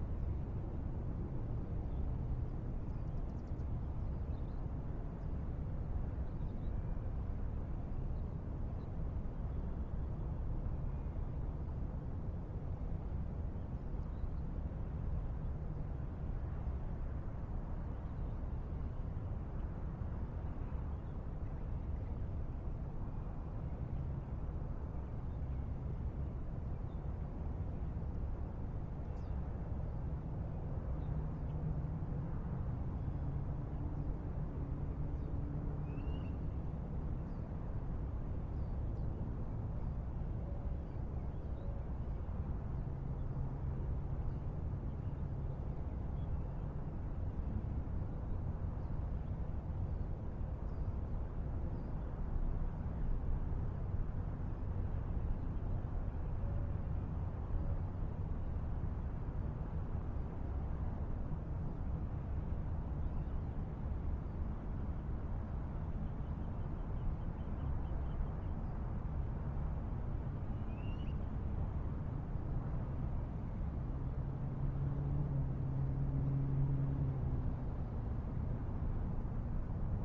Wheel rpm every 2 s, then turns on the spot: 0, 0, 0, 0, 0, 0, 0, 0, 0, 0, 0, 0, 0, 0, 0, 0, 0, 0, 0, 0, 0, 0, 0, 0, 0, 0, 0, 0, 0, 0, 0, 0, 0, 0, 0, 0, 0, 0, 0, 0.
none